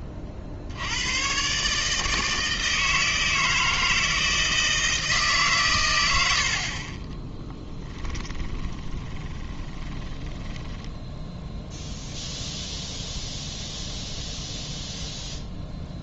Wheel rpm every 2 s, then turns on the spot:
60, 160, 160, 50, 20, 10, 0, 0.
8-12